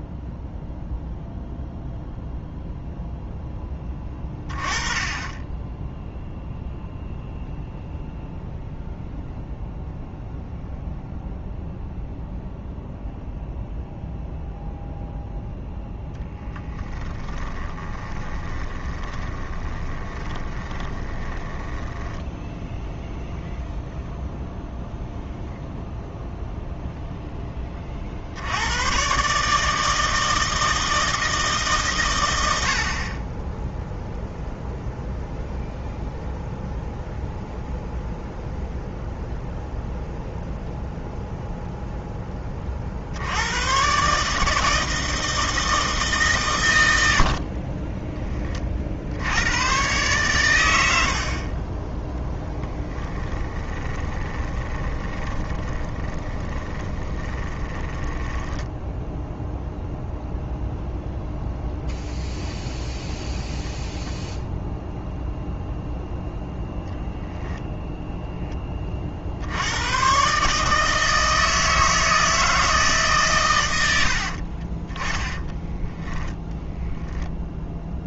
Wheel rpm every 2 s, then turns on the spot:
0, 0, 20, 0, 0, 0, 0, 0, 10, 20, 10, 0, 0, 0, 110, 160, 60, 0, 0, 0, 0, 50, 160, 100, 50, 80, 10, 20, 20, 10, 0, 0, 0, 0, 30, 160, 150, 30, 10.
16-22 52-60 74-76